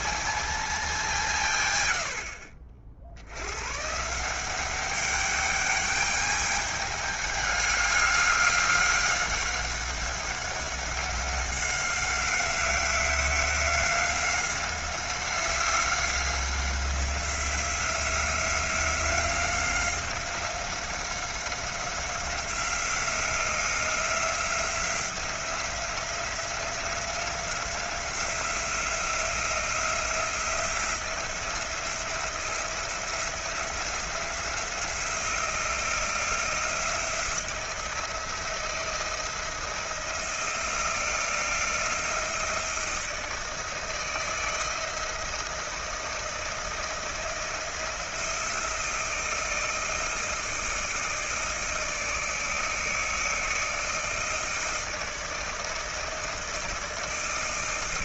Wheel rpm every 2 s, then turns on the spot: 190, 70, 200, 210, 200, 190, 190, 190, 180, 180, 180, 180, 180, 180, 170, 170, 170, 170, 170, 170, 170, 160, 160, 170, 160, 160, 160, 160, 160.
none